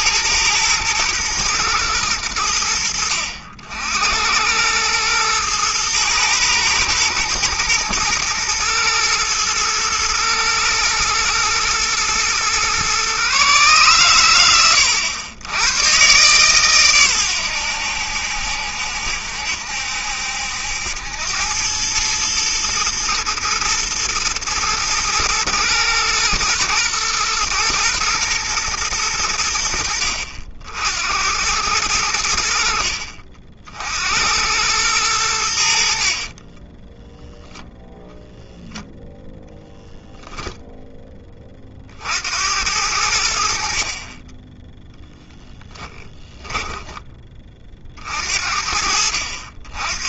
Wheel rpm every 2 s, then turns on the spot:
110, 80, 110, 120, 110, 110, 130, 100, 120, 70, 80, 110, 110, 110, 110, 70, 50, 100, 20, 0, 10, 80, 0, 10, 60.
36-38